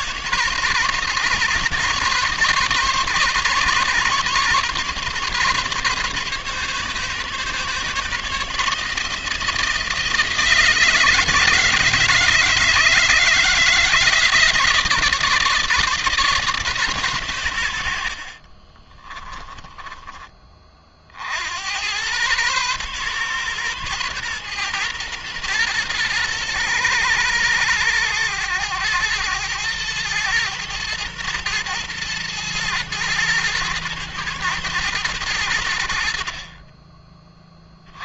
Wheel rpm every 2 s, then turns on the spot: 150, 150, 140, 140, 150, 160, 160, 150, 140, 30, 40, 130, 120, 120, 110, 110, 110, 110, 30.
18-20